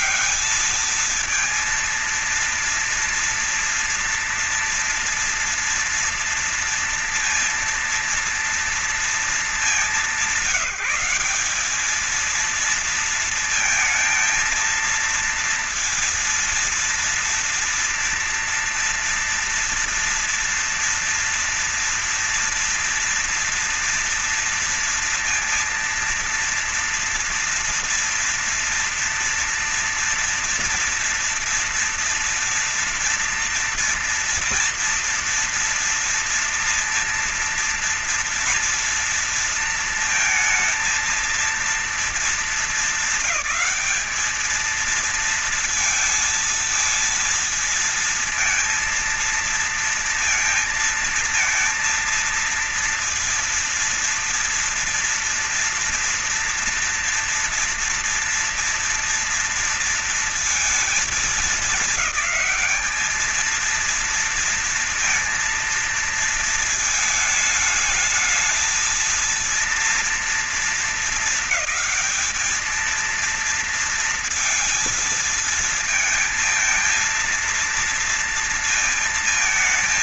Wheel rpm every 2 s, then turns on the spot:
210, 230, 230, 230, 230, 180, 220, 220, 230, 230, 230, 230, 230, 230, 230, 230, 230, 240, 240, 230, 220, 210, 210, 230, 230, 230, 230, 230, 230, 230, 230, 210, 230, 220, 220, 230, 220, 230, 230, 230.
none